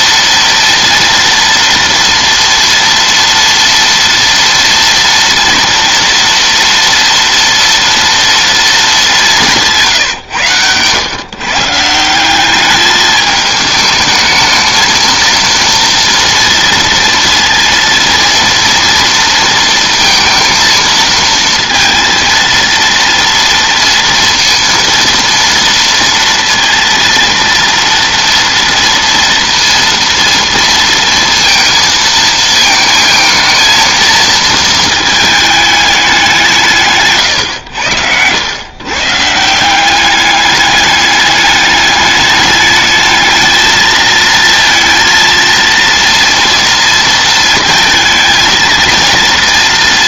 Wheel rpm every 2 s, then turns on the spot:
230, 230, 230, 230, 220, 110, 210, 220, 230, 230, 230, 230, 230, 230, 230, 230, 220, 220, 150, 120, 210, 210, 230, 230, 230.
none